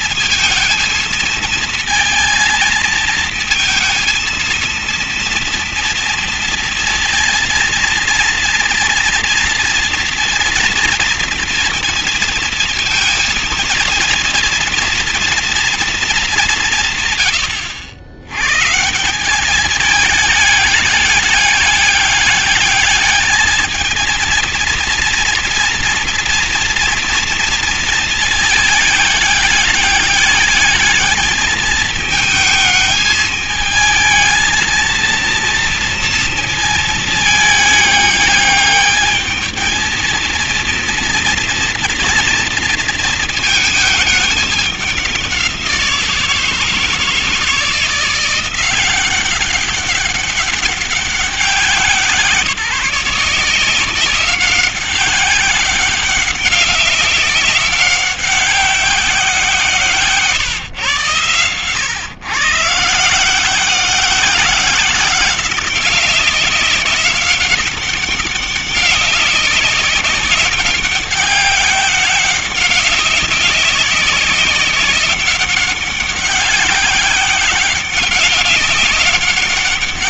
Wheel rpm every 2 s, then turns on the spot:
220, 220, 230, 230, 230, 230, 230, 230, 200, 110, 210, 210, 230, 230, 220, 210, 210, 220, 230, 210, 230, 230, 210, 160, 180, 200, 170, 190, 190, 190, 150, 130, 180, 190, 190, 190, 190, 190, 190, 190.
none